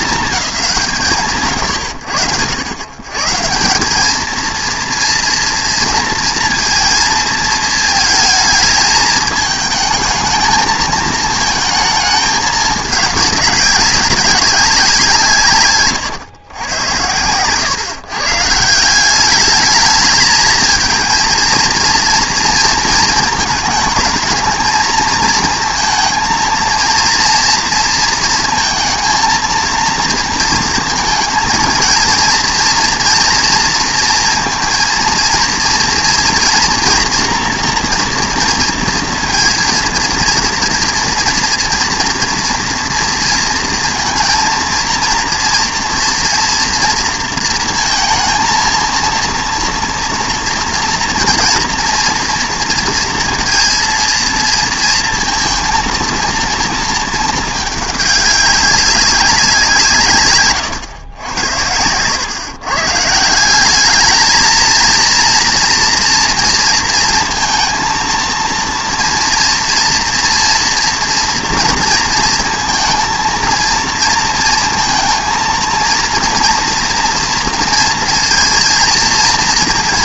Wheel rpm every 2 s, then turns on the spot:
190, 100, 230, 230, 220, 220, 210, 180, 100, 170, 230, 230, 230, 230, 220, 230, 230, 230, 230, 230, 230, 230, 230, 230, 220, 240, 230, 230, 230, 200, 130, 140, 230, 230, 230, 240, 230, 230, 230, 230.
none